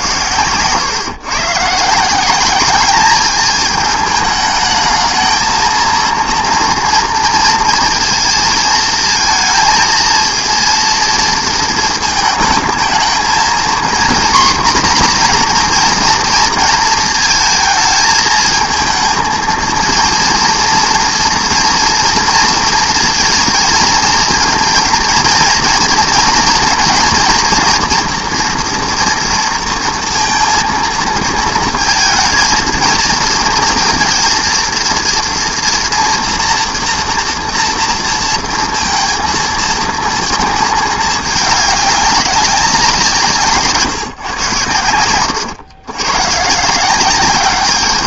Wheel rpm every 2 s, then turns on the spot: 120, 200, 210, 230, 230, 230, 220, 250, 230, 220, 230, 230, 230, 230, 230, 230, 230, 230, 240, 230, 220, 190, 120, 160.
none